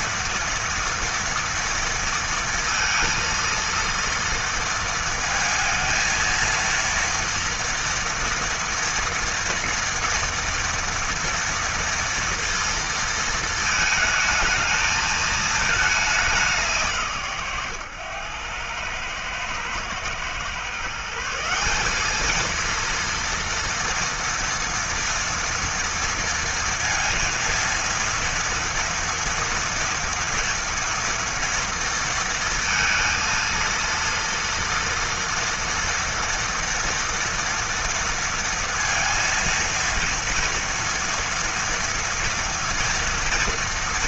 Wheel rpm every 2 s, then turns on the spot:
230, 230, 230, 230, 230, 230, 230, 220, 140, 110, 160, 230, 230, 230, 230, 230, 230, 230, 230, 230, 230, 230.
none